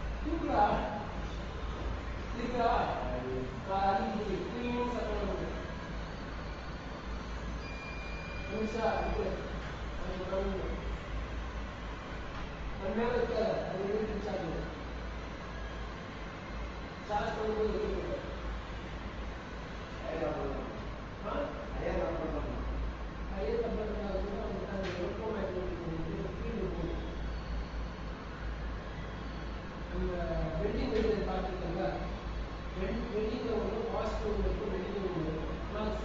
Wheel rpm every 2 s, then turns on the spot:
0, 0, 0, 0, 0, 0, 0, 0, 0, 0, 0, 0, 0, 0, 0, 0, 0, 0.
none